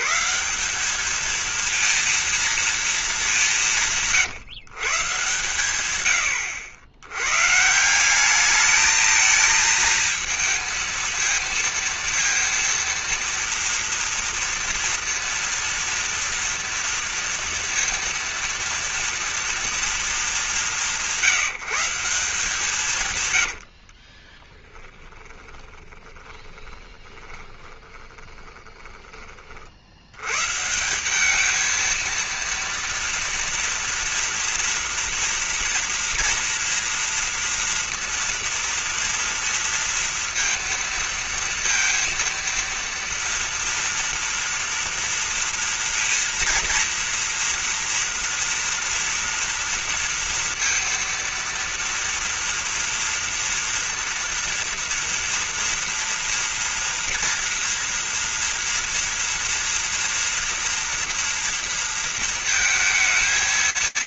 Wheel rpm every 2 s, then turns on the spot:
190, 230, 150, 100, 220, 230, 230, 230, 230, 230, 200, 160, 30, 20, 20, 150, 230, 230, 240, 230, 230, 230, 230, 230, 230, 230, 230, 230, 230, 230, 240, 230.
24-30